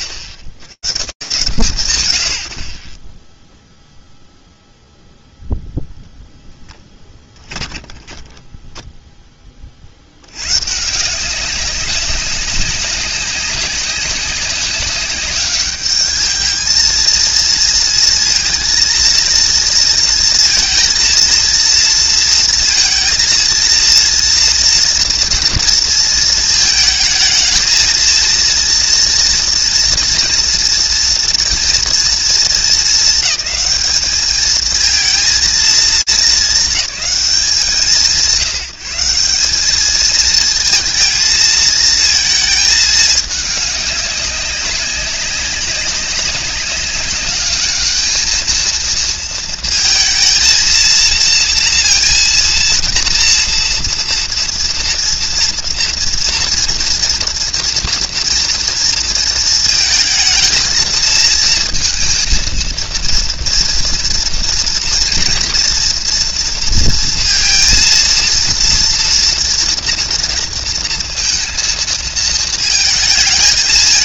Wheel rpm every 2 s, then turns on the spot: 90, 110, 0, 10, 10, 170, 200, 200, 220, 230, 230, 230, 230, 220, 240, 230, 220, 220, 200, 180, 230, 210, 200, 200, 230, 230, 230, 230, 230, 230, 230, 230, 230, 230, 230, 230, 220.
6-8